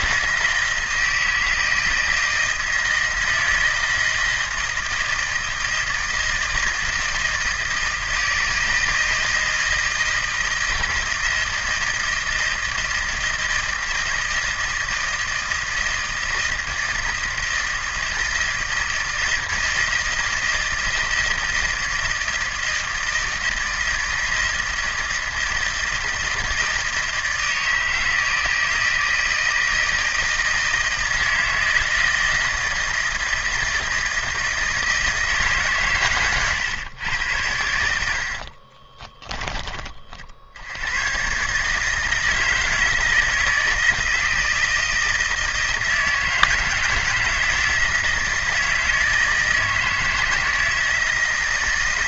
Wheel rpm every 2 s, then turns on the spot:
160, 160, 160, 160, 160, 160, 160, 160, 160, 160, 160, 160, 160, 160, 160, 160, 160, 160, 120, 40, 90, 160, 160, 160, 160, 160.
38-40